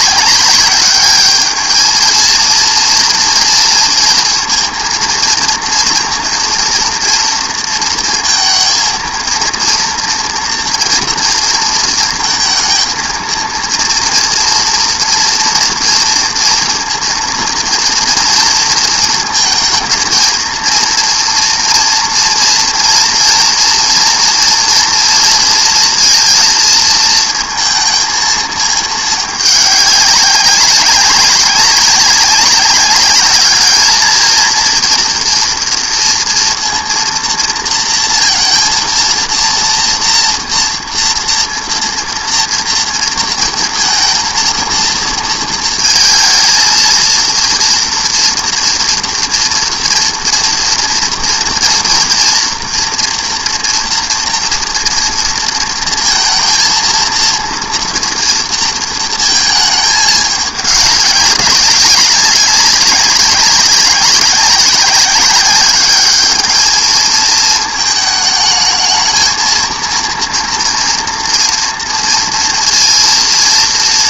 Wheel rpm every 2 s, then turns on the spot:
200, 230, 230, 240, 220, 240, 230, 240, 230, 230, 230, 230, 230, 230, 220, 190, 200, 230, 230, 230, 230, 230, 230, 230, 230, 230, 230, 240, 230, 230, 210, 190, 190, 220, 220, 240, 230.
none